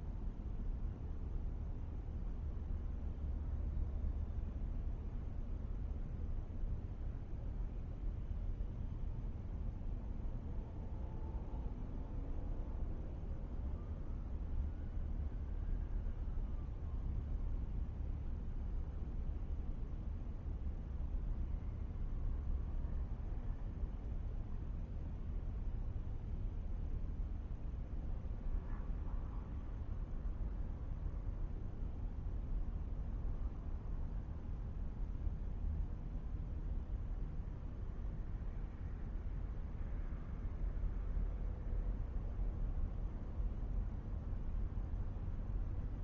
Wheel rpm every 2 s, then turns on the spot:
0, 0, 0, 0, 0, 0, 0, 0, 0, 0, 0, 0, 0, 0, 0, 0, 0, 0, 0, 0, 0, 0, 0.
none